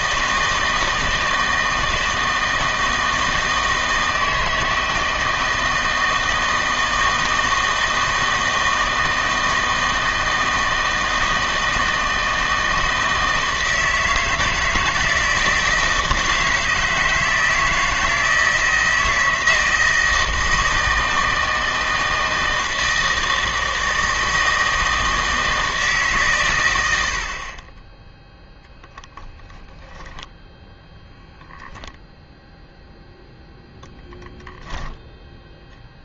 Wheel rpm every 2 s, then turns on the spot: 160, 160, 160, 160, 160, 160, 160, 160, 160, 160, 160, 160, 160, 100, 20, 10, 0, 10.
28-30